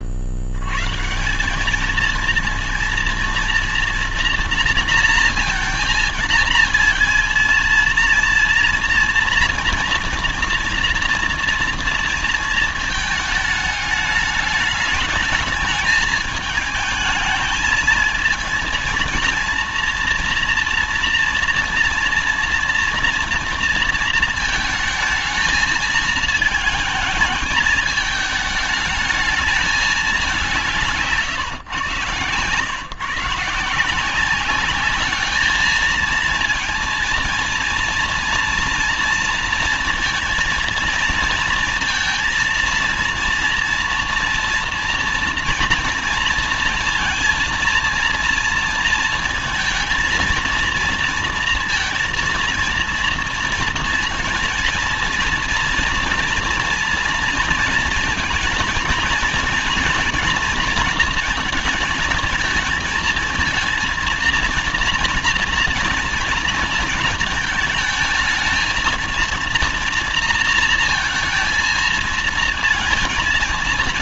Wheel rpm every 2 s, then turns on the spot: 90, 230, 230, 230, 230, 230, 230, 210, 220, 220, 240, 230, 220, 220, 210, 180, 140, 200, 230, 230, 230, 230, 230, 230, 230, 230, 230, 230, 230, 230, 230, 220, 230, 230, 230, 230, 220.
none